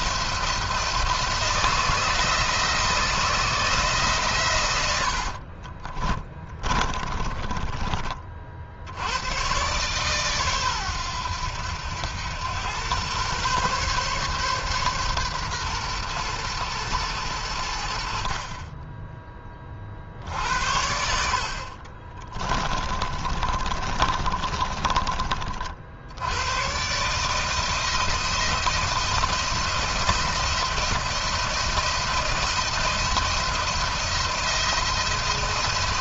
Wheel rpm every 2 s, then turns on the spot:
170, 160, 120, 30, 60, 130, 100, 130, 120, 40, 70, 20, 30, 110, 170, 170, 170, 170.
6-8 22-26